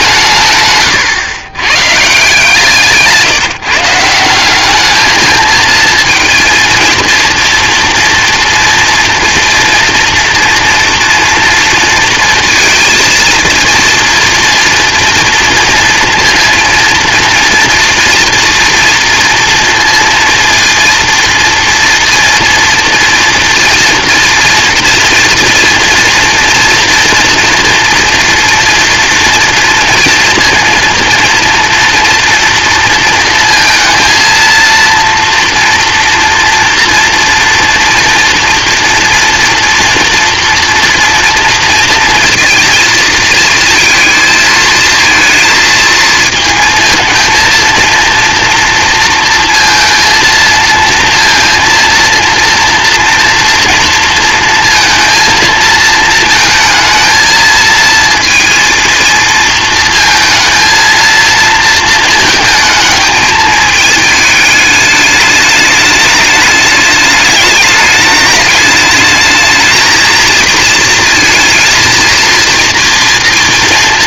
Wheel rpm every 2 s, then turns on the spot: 150, 160, 200, 230, 230, 240, 230, 230, 240, 230, 230, 240, 240, 230, 230, 230, 230, 230, 230, 230, 230, 230, 230, 230, 230, 230, 230, 230, 220, 230, 230, 220, 210, 210, 210, 230, 230.
none